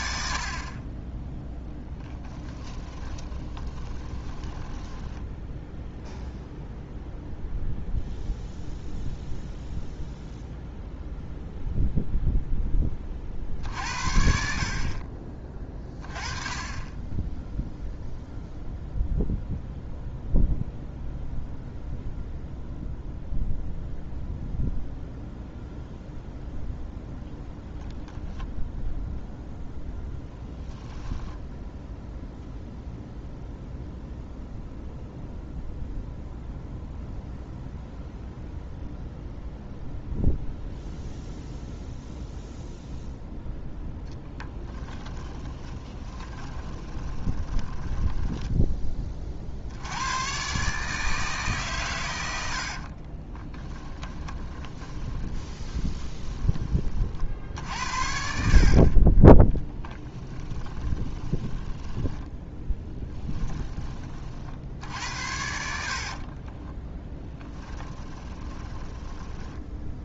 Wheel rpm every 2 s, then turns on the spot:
20, 10, 10, 0, 0, 0, 20, 40, 20, 0, 0, 0, 0, 0, 0, 10, 0, 0, 0, 0, 0, 0, 10, 20, 30, 150, 50, 20, 40, 50, 20, 10, 70, 20, 20.
2-6 30-32 44-48 52-56 58-64 66-70